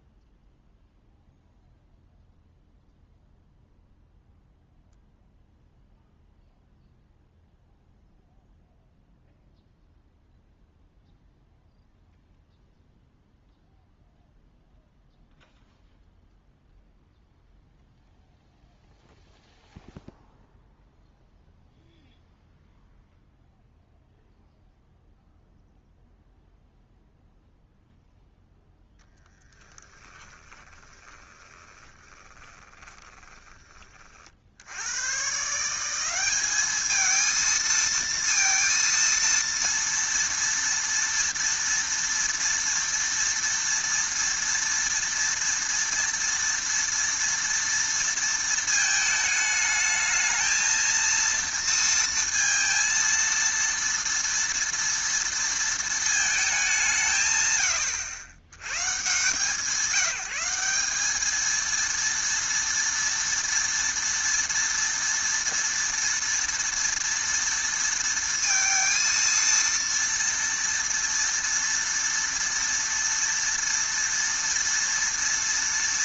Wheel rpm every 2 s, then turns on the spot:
0, 0, 0, 0, 0, 0, 0, 0, 0, 0, 0, 0, 0, 0, 0, 20, 20, 70, 210, 230, 230, 230, 230, 230, 220, 220, 230, 230, 190, 130, 180, 230, 230, 230, 230, 230, 230, 230.
30-34